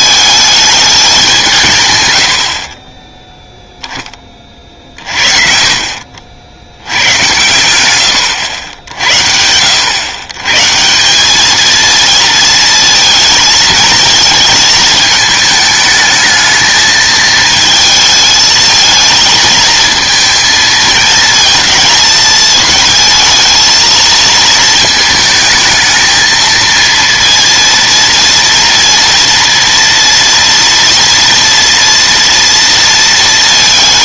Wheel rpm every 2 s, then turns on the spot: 210, 50, 40, 80, 90, 150, 230, 220, 220, 220, 220, 220, 220, 230, 230, 230, 230.
none